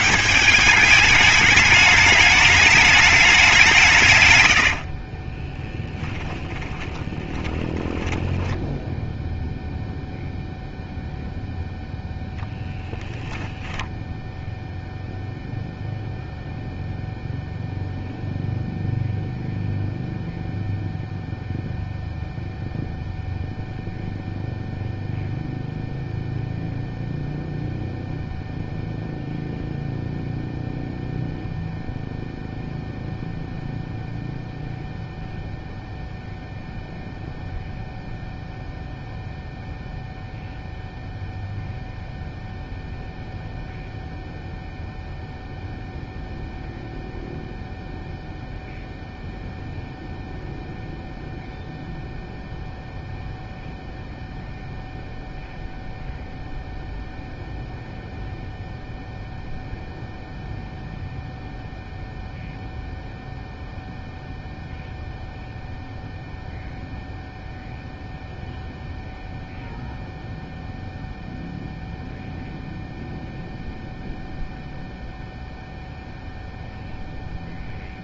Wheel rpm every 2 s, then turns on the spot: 200, 210, 70, 20, 10, 0, 0, 0, 0, 0, 0, 0, 0, 0, 0, 0, 0, 0, 0, 0, 0, 0, 0, 0, 0, 0, 0, 0, 0, 0, 0, 0, 0, 0, 0, 0, 0, 0, 0.
4-10